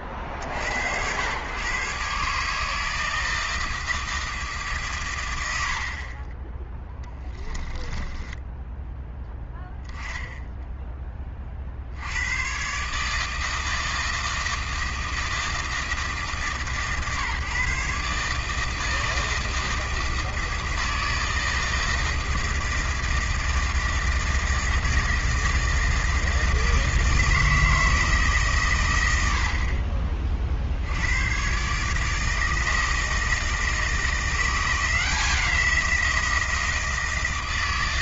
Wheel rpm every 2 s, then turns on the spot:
70, 150, 150, 10, 10, 10, 120, 160, 150, 160, 160, 160, 160, 160, 130, 60, 160, 180, 160.
6-8